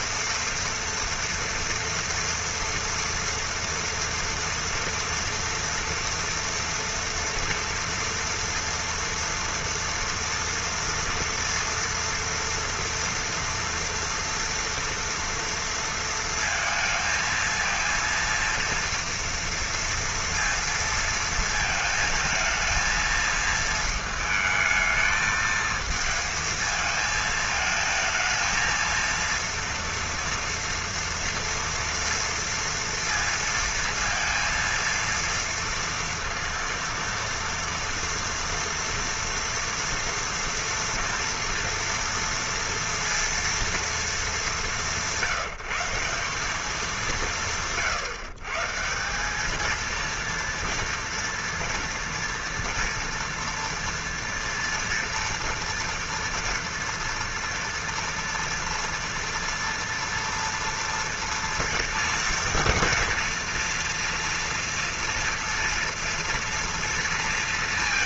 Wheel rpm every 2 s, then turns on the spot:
230, 230, 230, 230, 240, 230, 230, 230, 230, 230, 230, 220, 220, 220, 230, 230, 230, 230, 230, 230, 230, 230, 180, 200, 150, 230, 230, 230, 230, 230, 230, 230, 240, 230.
none